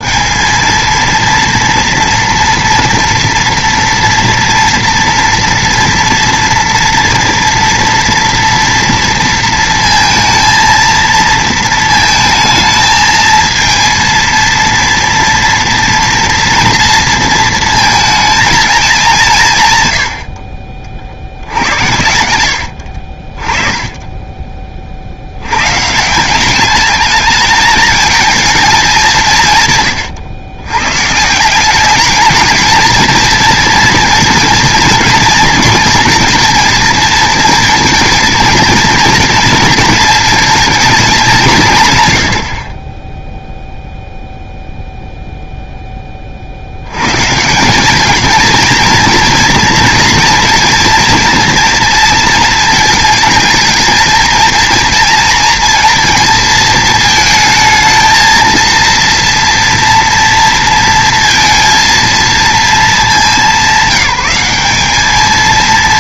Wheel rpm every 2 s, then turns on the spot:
220, 230, 230, 230, 230, 230, 220, 230, 230, 210, 50, 80, 40, 200, 210, 110, 220, 220, 220, 230, 220, 40, 0, 80, 230, 230, 220, 230, 220, 230, 230, 220, 200.
none